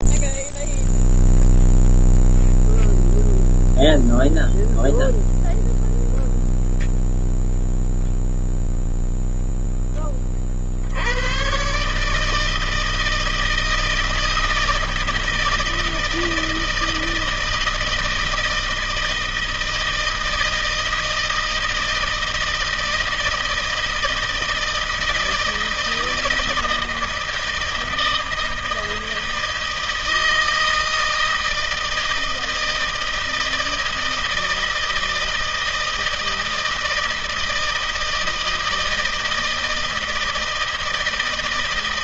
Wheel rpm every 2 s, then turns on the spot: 0, 0, 0, 0, 0, 60, 160, 160, 160, 160, 160, 160, 160, 160, 160, 160, 160, 160, 160, 160, 160.
none